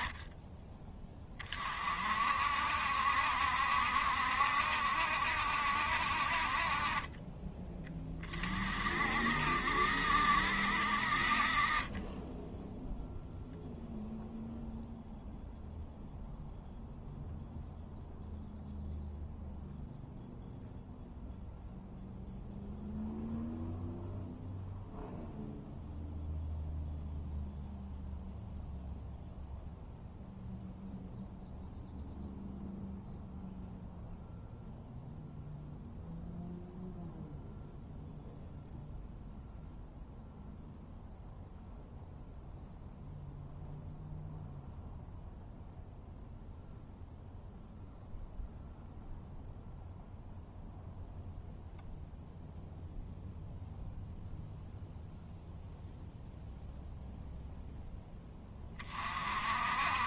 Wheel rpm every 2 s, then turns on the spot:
10, 60, 70, 40, 40, 60, 0, 0, 0, 0, 0, 0, 0, 0, 0, 0, 0, 0, 0, 0, 0, 0, 0, 0, 0, 0, 0, 0, 0, 30.
none